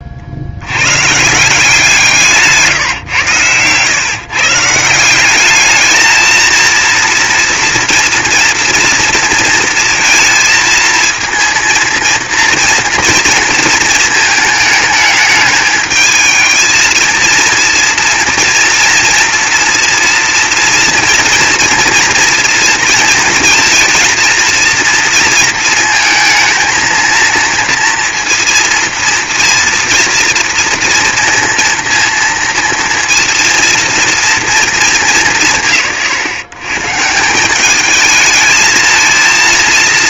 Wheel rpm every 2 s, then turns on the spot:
80, 160, 160, 230, 230, 230, 230, 210, 220, 230, 230, 230, 230, 220, 230, 230, 230, 220, 130, 220.
none